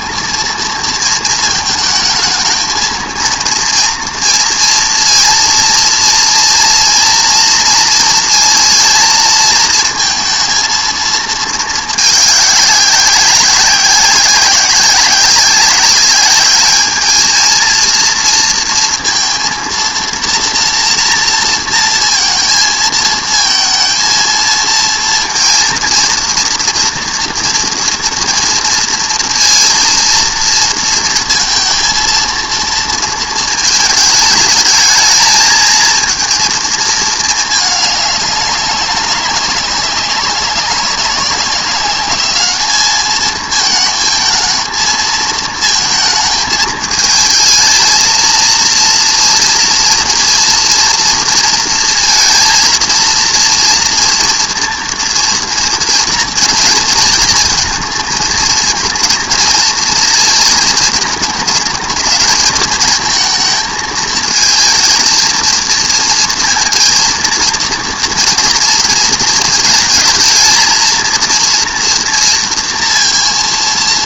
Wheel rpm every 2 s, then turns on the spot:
230, 220, 230, 230, 230, 220, 190, 190, 230, 230, 230, 220, 230, 230, 230, 230, 220, 220, 210, 190, 190, 220, 220, 220, 230, 230, 230, 230, 230, 230, 220, 220, 230, 230, 220, 230, 230.
none